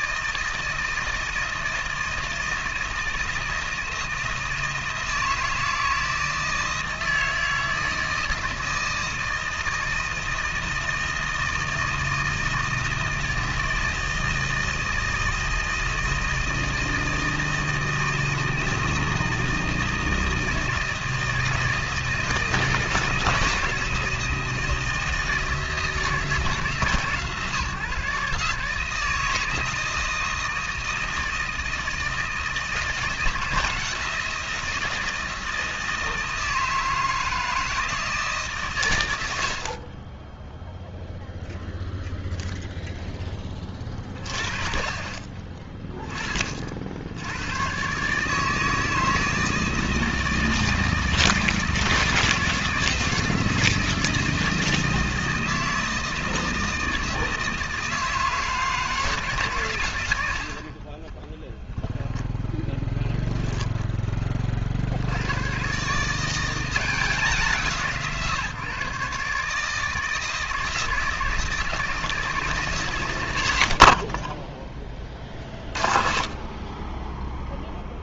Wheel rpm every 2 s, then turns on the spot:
160, 160, 160, 160, 160, 160, 160, 160, 160, 160, 160, 160, 160, 150, 160, 160, 160, 160, 160, 100, 0, 10, 30, 80, 160, 160, 160, 160, 160, 150, 20, 10, 80, 180, 150, 160, 100, 30, 10.
60-64